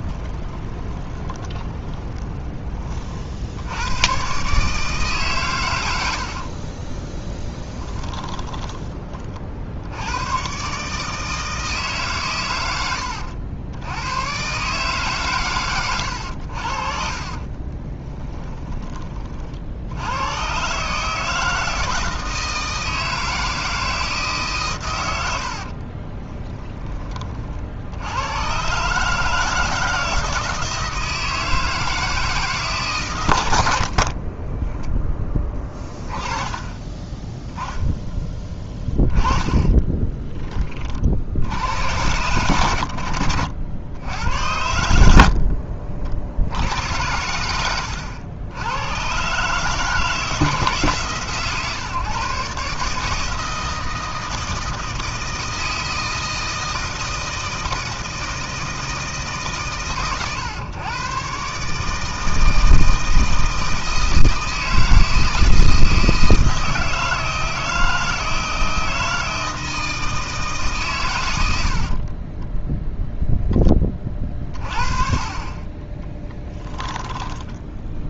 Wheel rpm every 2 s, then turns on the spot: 20, 40, 150, 20, 20, 150, 100, 140, 50, 30, 150, 160, 100, 20, 140, 160, 140, 10, 20, 10, 50, 80, 70, 90, 110, 150, 150, 160, 160, 150, 130, 160, 160, 160, 160, 130, 0, 30, 10.
0-2 6-8 16-18 38-40